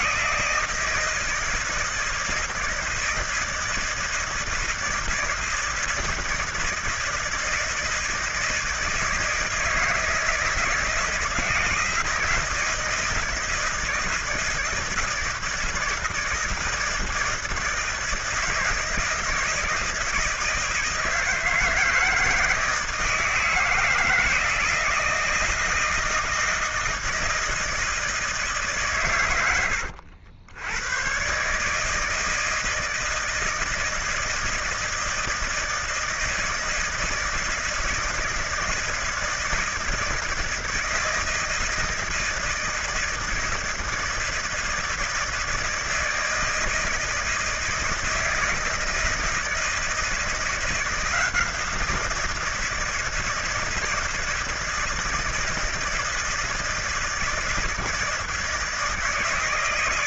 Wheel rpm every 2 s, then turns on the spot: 160, 160, 160, 160, 160, 160, 160, 160, 160, 160, 160, 160, 160, 160, 140, 110, 160, 160, 160, 160, 160, 160, 160, 160, 160, 170, 160, 160, 160, 160.
none